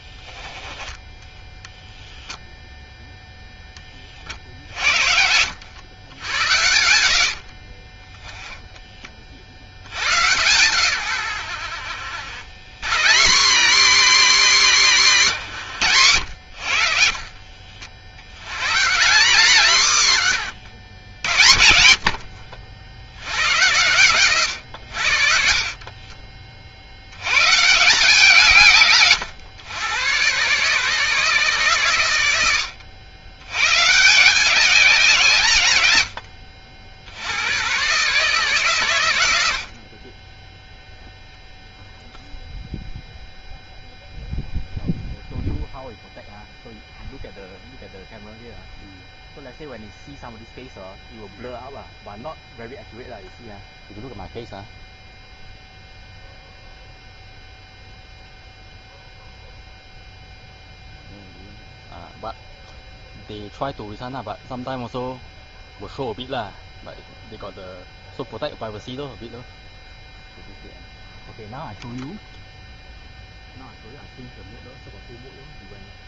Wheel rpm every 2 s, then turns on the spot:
10, 0, 50, 80, 10, 120, 100, 200, 90, 100, 100, 60, 120, 50, 150, 130, 90, 170, 60, 140, 10, 0, 0, 0, 0, 0, 0, 0, 0, 0, 0, 0, 0, 0, 0, 0, 0, 0.
4-6 20-22